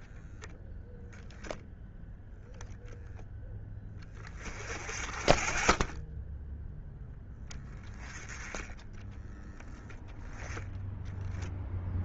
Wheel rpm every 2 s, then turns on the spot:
0, 0, 20, 0, 20, 10.
8-10